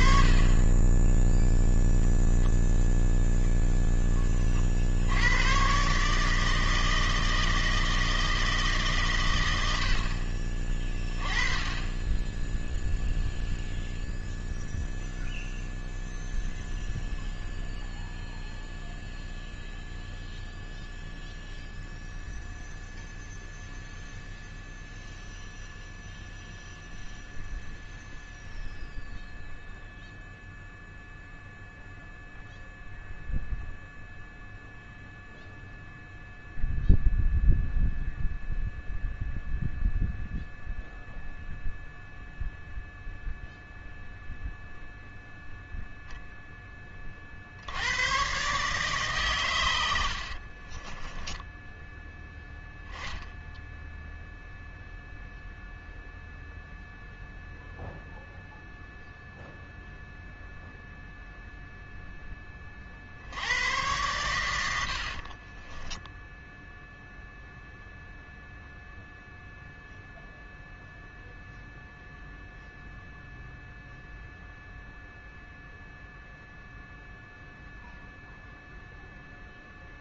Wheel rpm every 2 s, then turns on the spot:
30, 0, 10, 140, 160, 60, 20, 0, 0, 0, 0, 0, 0, 0, 0, 0, 0, 0, 0, 0, 0, 0, 0, 0, 130, 50, 10, 0, 0, 0, 0, 10, 110, 0, 0, 0, 0, 0, 0, 0.
50-52